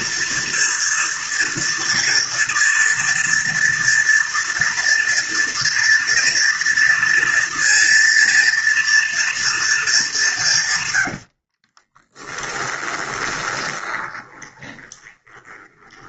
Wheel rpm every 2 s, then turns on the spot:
230, 230, 240, 230, 230, 130, 10, 20.
10-16